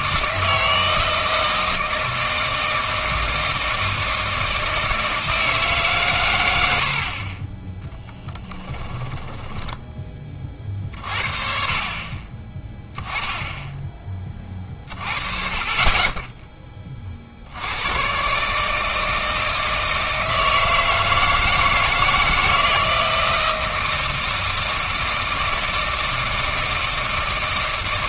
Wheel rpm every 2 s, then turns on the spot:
160, 160, 160, 70, 10, 40, 20, 30, 10, 150, 160, 160, 160, 160.
8-10